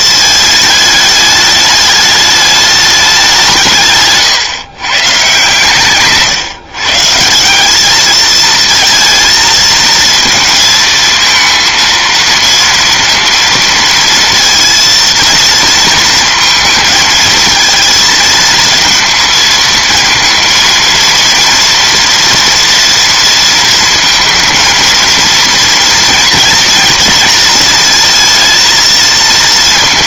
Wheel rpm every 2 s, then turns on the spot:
220, 210, 140, 140, 230, 220, 230, 230, 220, 230, 230, 230, 230, 230, 230.
none